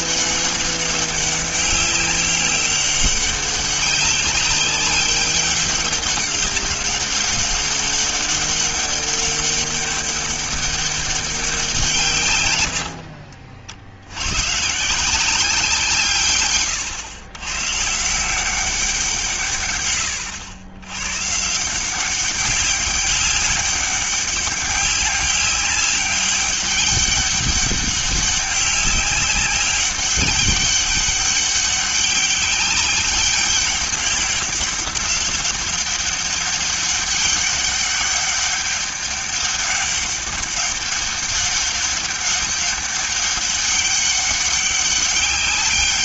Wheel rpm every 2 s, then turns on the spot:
200, 200, 190, 200, 200, 200, 90, 140, 120, 180, 90, 200, 200, 200, 200, 200, 200, 190, 200, 200, 200, 200, 200.
none